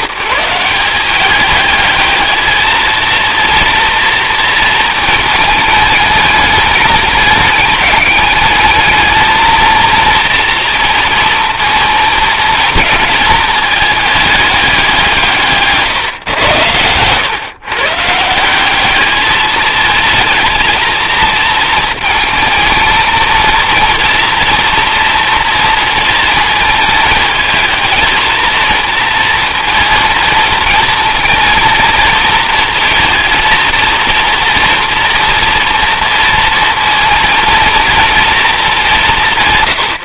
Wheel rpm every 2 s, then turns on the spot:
160, 220, 230, 210, 210, 230, 220, 210, 120, 170, 230, 220, 240, 230, 230, 230, 230, 230, 230, 230.
none